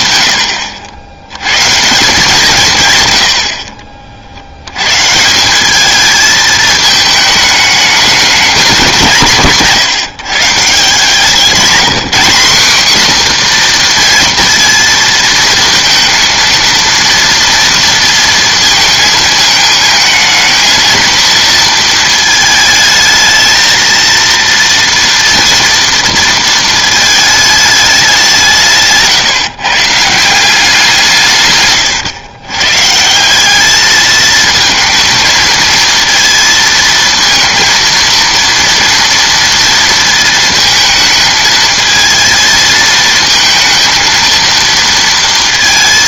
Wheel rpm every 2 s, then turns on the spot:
80, 160, 90, 220, 200, 160, 220, 230, 230, 230, 220, 220, 230, 220, 170, 190, 130, 220, 230, 230, 220, 220, 230.
none